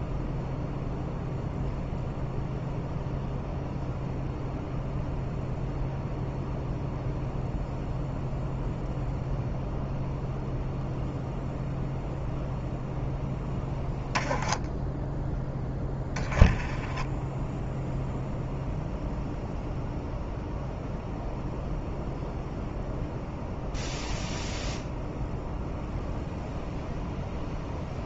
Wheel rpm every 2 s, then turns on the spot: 0, 0, 0, 0, 0, 0, 0, 10, 10, 0, 0, 0, 0, 0.
none